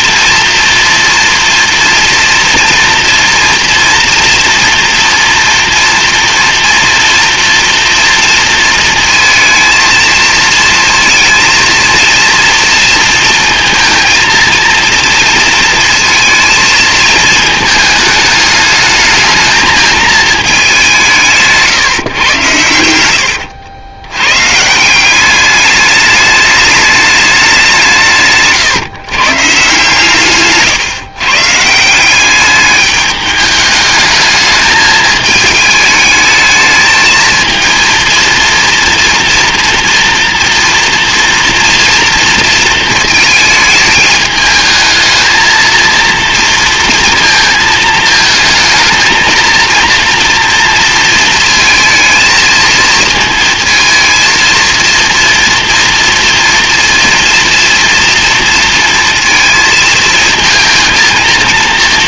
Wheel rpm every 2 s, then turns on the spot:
230, 230, 230, 230, 230, 230, 230, 230, 220, 210, 210, 110, 140, 210, 150, 150, 200, 210, 220, 230, 230, 230, 210, 230, 220, 230, 230, 230, 230, 230, 230.
28-32